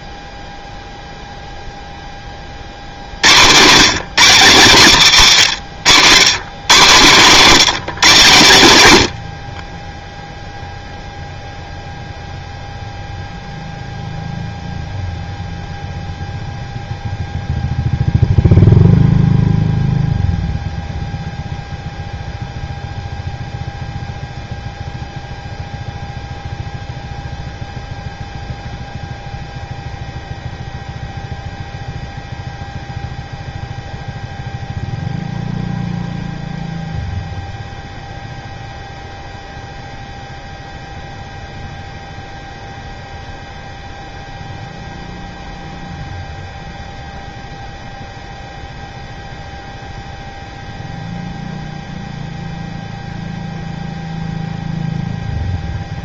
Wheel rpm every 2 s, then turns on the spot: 0, 50, 150, 140, 110, 0, 0, 0, 0, 0, 0, 0, 0, 0, 0, 0, 0, 0, 0, 0, 0, 0, 0, 0, 0, 0, 0, 0.
none